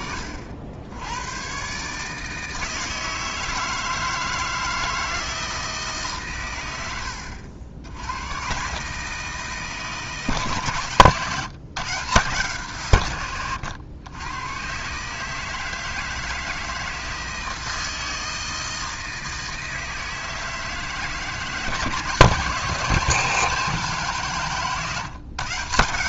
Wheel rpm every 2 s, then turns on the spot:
90, 160, 160, 90, 140, 140, 130, 130, 160, 160, 160, 170, 150.
none